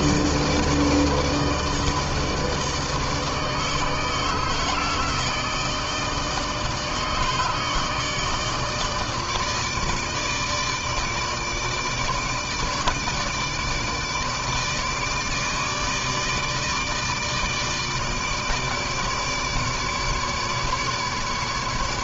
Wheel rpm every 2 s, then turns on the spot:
160, 160, 160, 160, 150, 150, 160, 150, 150, 150, 150.
none